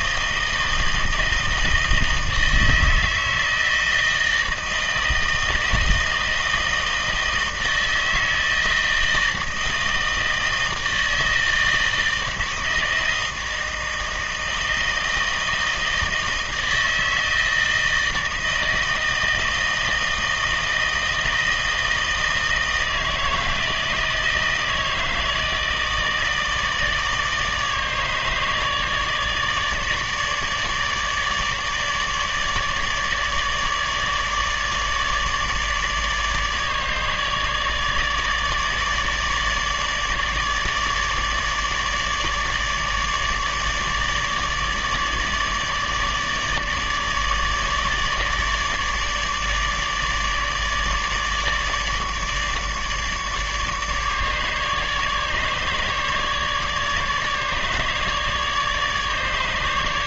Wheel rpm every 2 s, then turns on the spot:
160, 160, 160, 160, 160, 160, 160, 160, 160, 160, 160, 160, 160, 160, 150, 150, 150, 150, 150, 150, 150, 150, 150, 150, 150, 150, 150, 150, 150, 150.
none